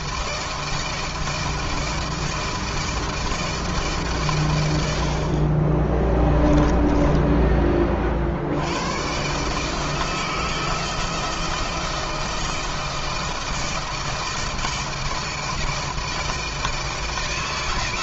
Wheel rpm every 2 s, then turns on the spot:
160, 160, 120, 20, 70, 160, 160, 170, 160.
6-8